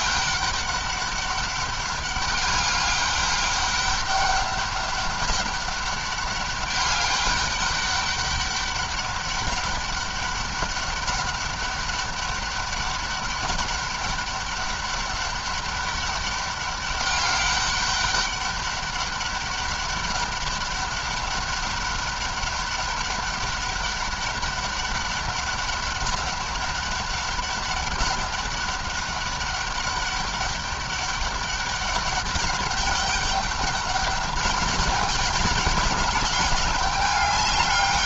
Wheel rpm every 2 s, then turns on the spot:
200, 200, 200, 200, 200, 200, 200, 200, 200, 200, 200, 200, 200, 200, 200, 200, 200, 200, 200.
none